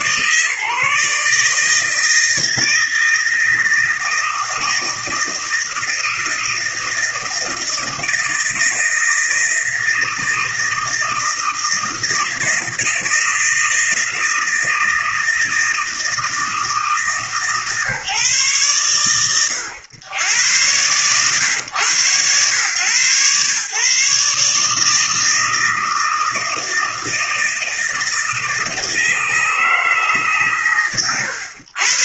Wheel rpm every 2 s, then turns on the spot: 150, 160, 160, 160, 160, 160, 160, 160, 160, 130, 110, 120, 150, 160, 160, 140.
none